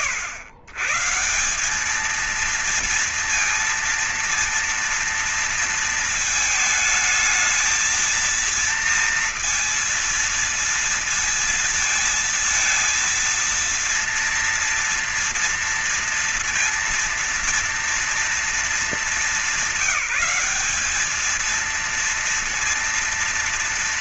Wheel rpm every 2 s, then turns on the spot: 130, 230, 230, 220, 230, 230, 230, 230, 230, 230, 200, 230.
none